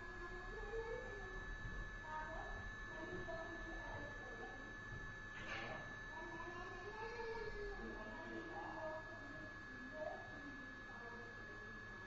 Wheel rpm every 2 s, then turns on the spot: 0, 0, 0, 0, 0, 0.
none